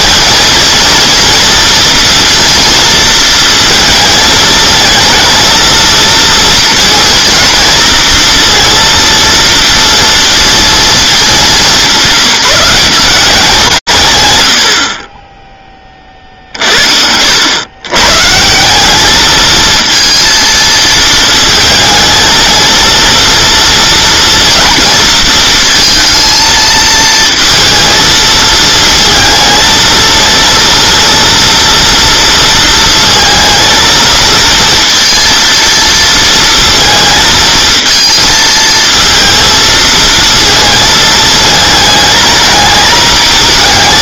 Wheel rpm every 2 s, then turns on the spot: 230, 230, 220, 230, 230, 230, 180, 70, 60, 180, 220, 230, 230, 220, 220, 230, 230, 230, 230, 230, 220, 220.
none